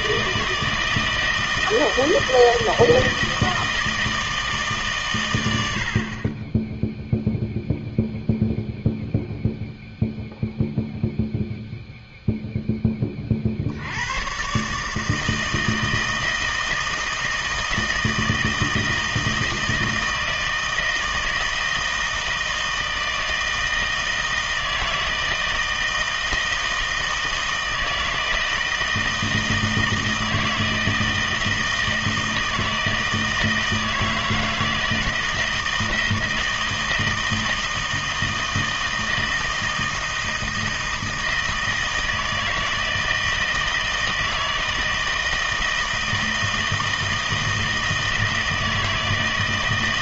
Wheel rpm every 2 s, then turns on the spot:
160, 160, 150, 20, 0, 0, 0, 130, 160, 160, 160, 160, 160, 160, 160, 160, 160, 160, 160, 160, 160, 160, 160, 160, 160.
none